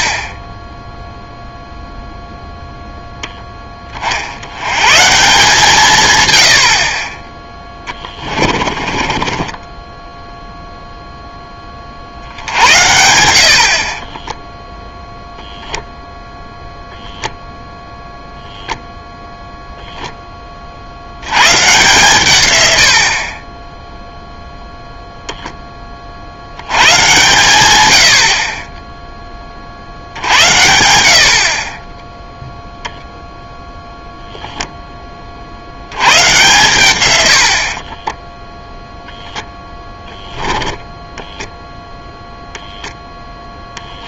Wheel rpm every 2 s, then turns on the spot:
20, 0, 100, 70, 30, 0, 70, 0, 0, 0, 30, 100, 0, 90, 30, 80, 0, 0, 120, 0, 10, 0.
8-10